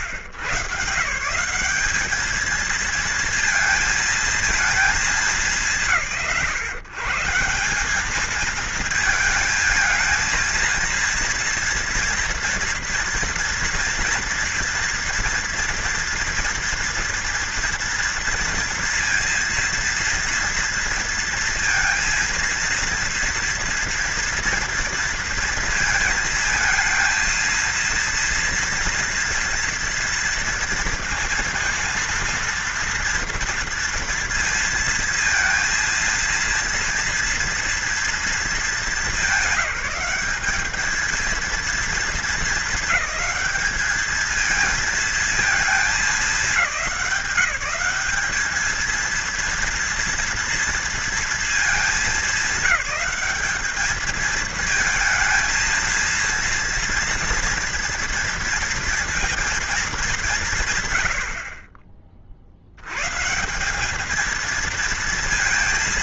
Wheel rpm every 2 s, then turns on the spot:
130, 220, 230, 130, 220, 220, 230, 230, 230, 230, 230, 230, 230, 230, 230, 230, 230, 230, 230, 220, 190, 220, 220, 210, 210, 230, 220, 220, 230, 230, 150, 50, 220.
none